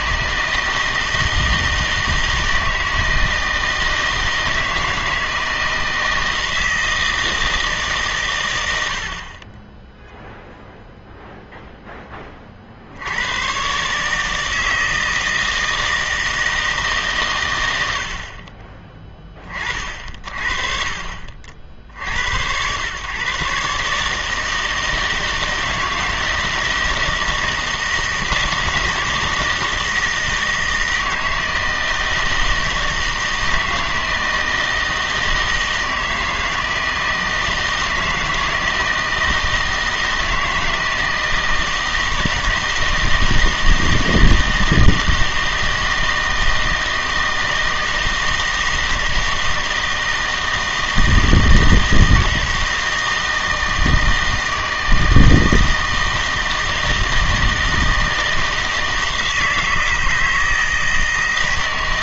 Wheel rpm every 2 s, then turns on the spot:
160, 160, 160, 160, 90, 0, 70, 160, 160, 30, 40, 110, 160, 160, 160, 160, 160, 160, 160, 160, 160, 160, 160, 160, 160, 160, 160, 160, 160, 160, 160.
none